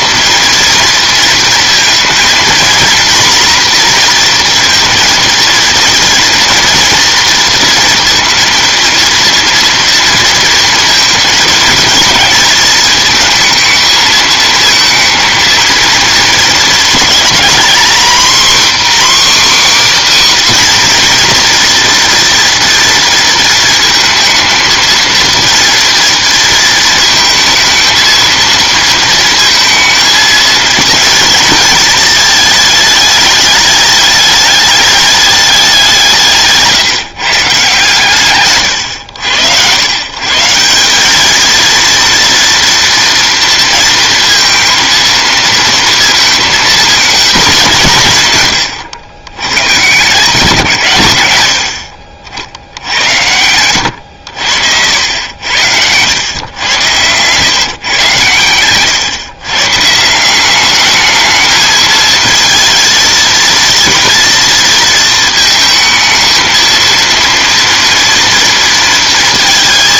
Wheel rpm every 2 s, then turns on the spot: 230, 230, 230, 230, 230, 230, 220, 220, 230, 270, 260, 230, 220, 220, 230, 220, 220, 210, 150, 110, 170, 230, 230, 230, 110, 140, 70, 70, 110, 120, 200, 220, 230, 220, 230.
none